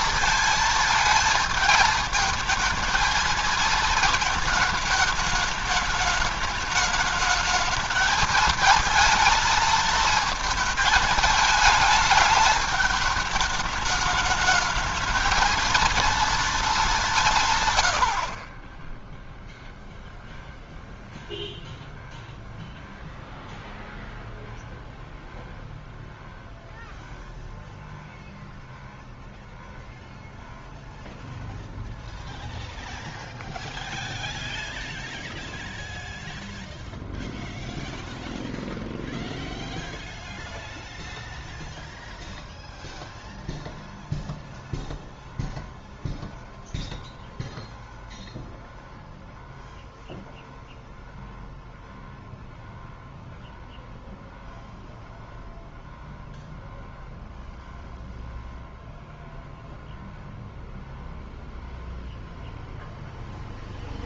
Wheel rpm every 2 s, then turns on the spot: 230, 220, 220, 210, 220, 230, 210, 210, 230, 40, 0, 0, 0, 0, 0, 0, 0, 0, 0, 0, 0, 0, 0, 0, 0, 0, 0, 0, 0, 0, 0, 0.
none